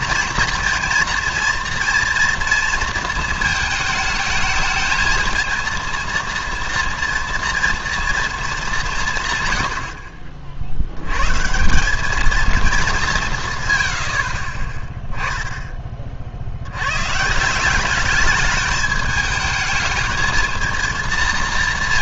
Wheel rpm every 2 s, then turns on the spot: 230, 230, 220, 230, 220, 60, 220, 40, 70, 210, 230.
none